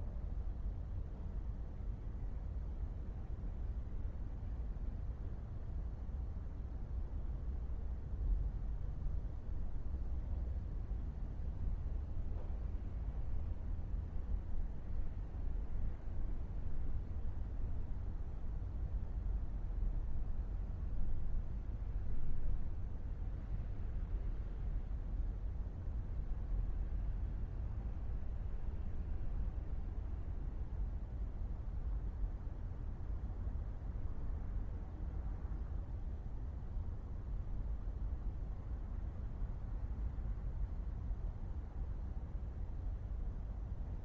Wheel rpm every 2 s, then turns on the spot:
0, 0, 0, 0, 0, 0, 0, 0, 0, 0, 0, 0, 0, 0, 0, 0, 0, 0, 0, 0, 0, 0.
none